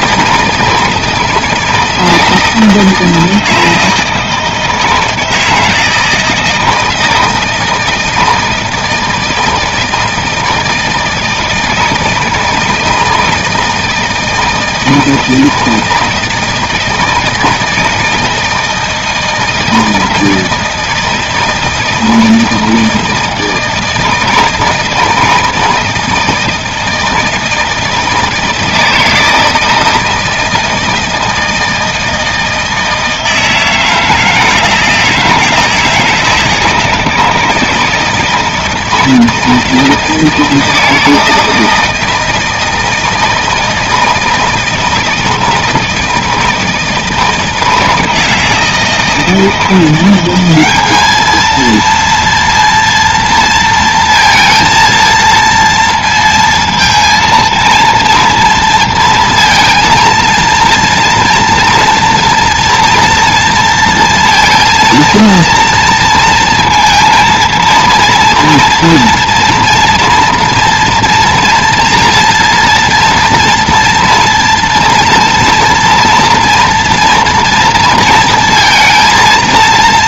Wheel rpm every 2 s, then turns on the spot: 160, 160, 160, 160, 160, 160, 160, 160, 160, 160, 160, 160, 160, 160, 160, 160, 160, 160, 160, 160, 160, 160, 160, 160, 160, 190, 230, 230, 230, 230, 230, 230, 230, 230, 230, 230, 230, 230, 230, 230.
none